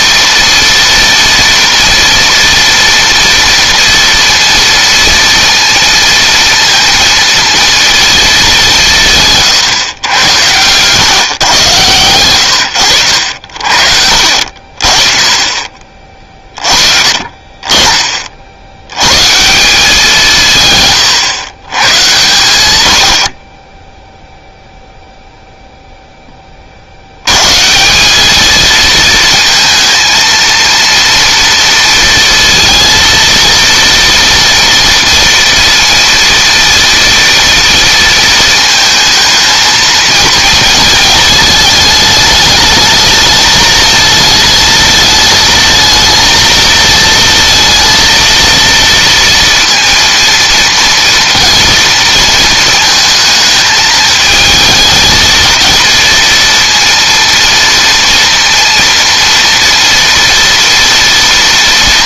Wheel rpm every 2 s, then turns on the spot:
230, 230, 230, 230, 200, 110, 100, 50, 30, 80, 150, 100, 0, 40, 220, 230, 230, 230, 230, 220, 230, 210, 220, 220, 230, 230, 230, 220, 230, 230, 230.
none